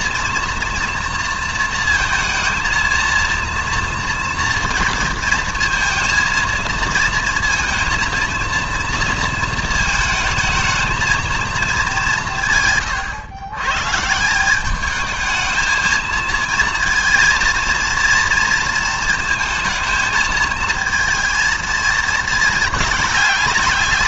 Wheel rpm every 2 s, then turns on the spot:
240, 230, 230, 230, 230, 220, 140, 190, 230, 230, 220, 210.
none